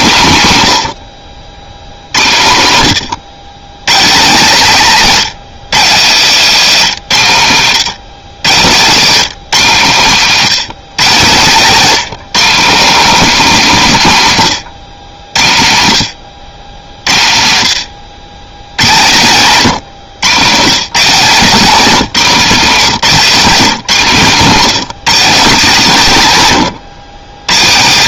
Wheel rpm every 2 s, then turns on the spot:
120, 100, 190, 180, 150, 170, 220, 120, 90, 120, 160, 190, 200, 140.
none